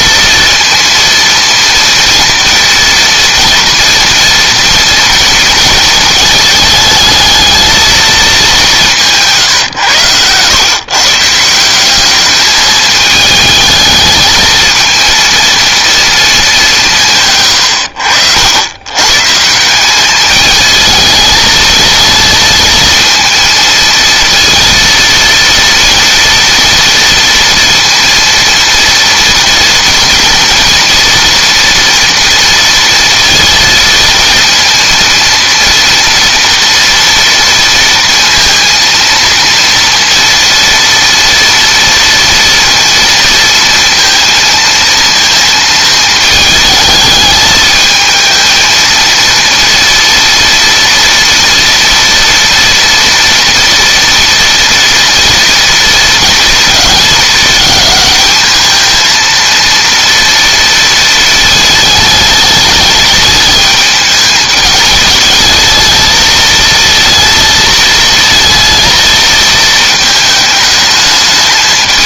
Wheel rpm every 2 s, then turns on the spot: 230, 230, 230, 220, 180, 130, 220, 220, 180, 100, 220, 230, 230, 230, 230, 230, 230, 230, 230, 230, 230, 230, 230, 220, 220, 230, 230, 230, 220, 220, 230, 210, 220, 230, 220, 210.
none